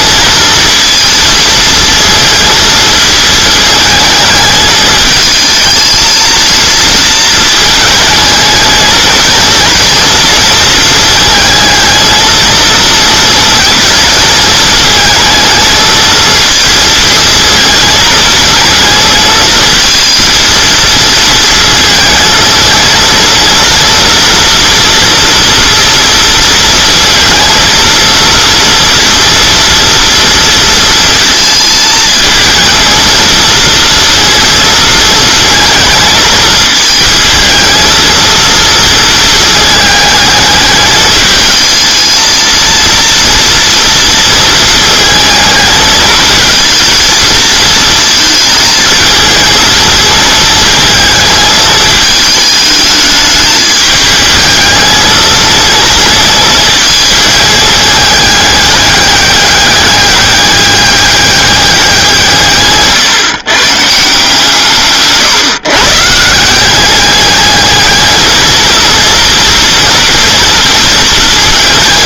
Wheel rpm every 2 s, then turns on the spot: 230, 220, 220, 230, 230, 220, 230, 220, 220, 230, 220, 230, 230, 230, 230, 230, 220, 230, 220, 230, 210, 230, 220, 220, 220, 220, 210, 220, 220, 200, 200, 140, 150, 190, 230, 230.
none